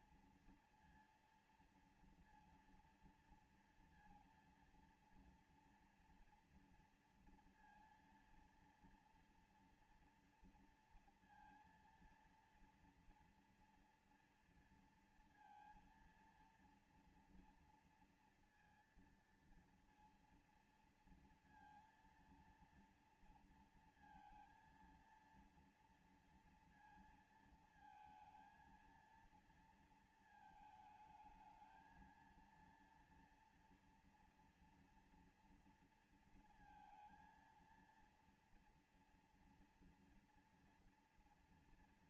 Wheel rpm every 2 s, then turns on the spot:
230, 230, 230, 240, 230, 230, 230, 230, 230, 230, 230, 230, 230, 230, 230, 220, 230, 230, 230, 230, 230.
none